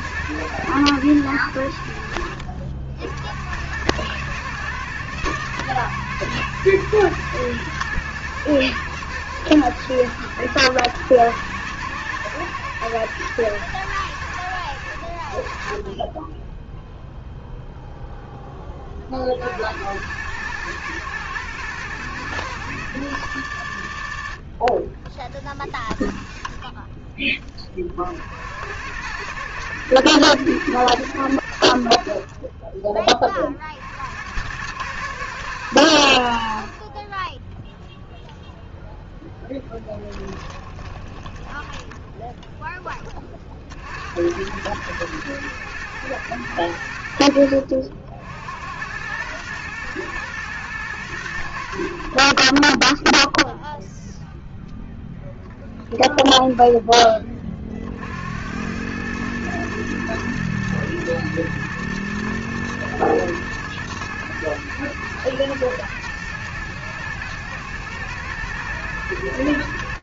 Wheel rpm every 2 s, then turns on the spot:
110, 60, 110, 110, 120, 110, 100, 90, 10, 10, 100, 100, 30, 0, 70, 110, 20, 90, 60, 0, 20, 10, 90, 110, 80, 120, 40, 0, 0, 90, 110, 110, 110, 110, 120.
40-42